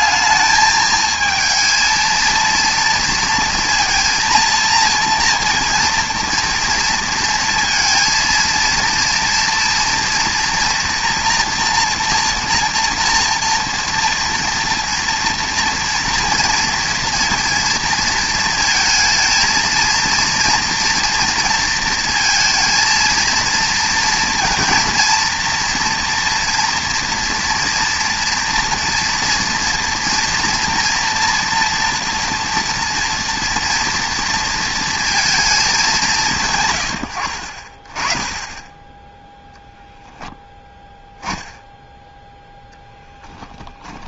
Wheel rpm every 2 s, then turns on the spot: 220, 230, 230, 230, 230, 230, 240, 230, 230, 230, 230, 230, 230, 240, 230, 230, 230, 230, 130, 20, 10, 10.
none